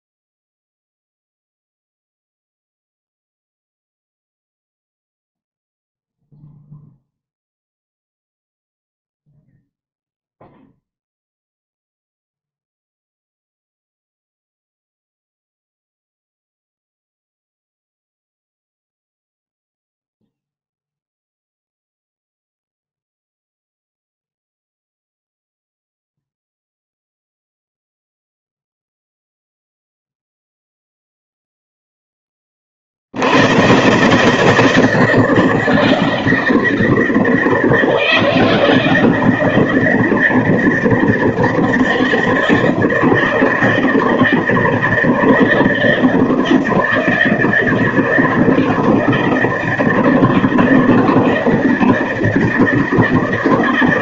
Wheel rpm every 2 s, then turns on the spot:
0, 0, 0, 0, 0, 0, 0, 0, 0, 0, 0, 0, 0, 0, 0, 0, 10, 150, 160, 160, 160, 160, 160, 160, 160, 160, 160.
none